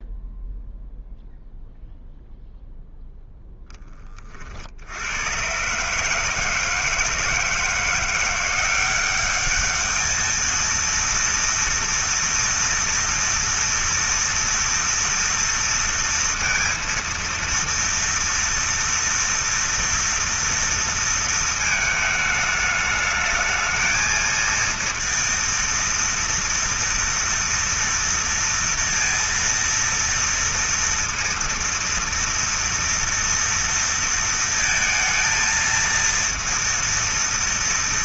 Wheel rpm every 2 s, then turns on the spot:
0, 0, 60, 160, 180, 230, 230, 230, 230, 230, 230, 220, 230, 230, 230, 230, 230, 230, 230.
none